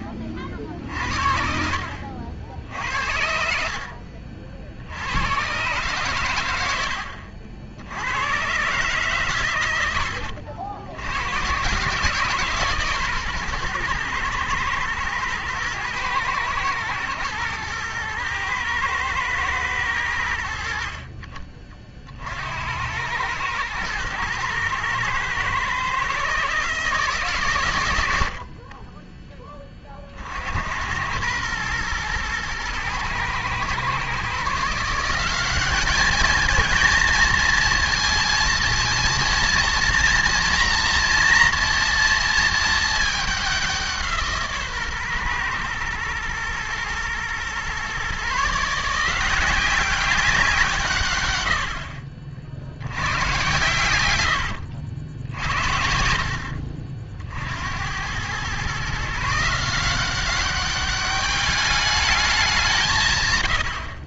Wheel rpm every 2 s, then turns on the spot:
60, 70, 60, 90, 130, 70, 150, 120, 110, 110, 70, 80, 110, 150, 40, 80, 110, 160, 220, 230, 230, 220, 140, 120, 150, 170, 60, 90, 60, 130, 200, 190.
2-4 54-56